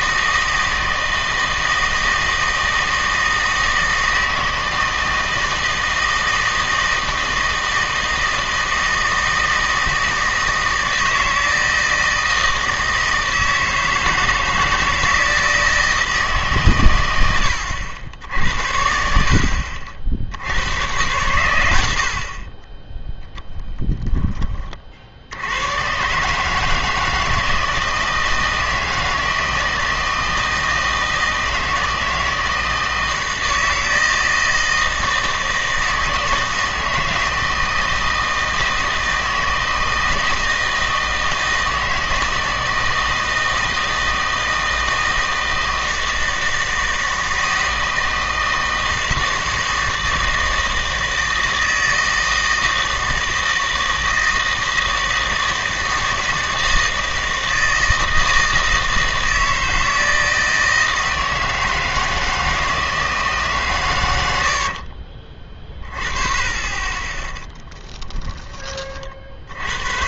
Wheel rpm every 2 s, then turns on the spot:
160, 160, 160, 160, 160, 160, 160, 160, 130, 70, 90, 20, 30, 160, 160, 160, 160, 160, 160, 160, 160, 160, 160, 160, 160, 160, 160, 160, 160, 160, 160, 160, 60, 20, 30.
64-66